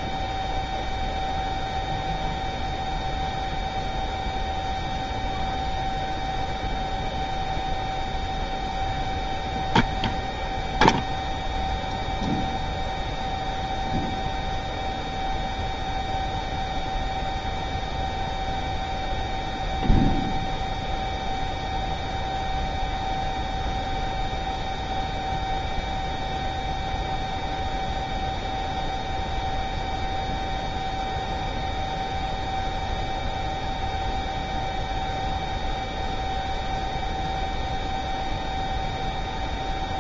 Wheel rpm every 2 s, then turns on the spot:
0, 0, 0, 0, 0, 0, 0, 0, 0, 0, 0, 0, 0, 0, 0, 0, 0, 0, 0, 0.
none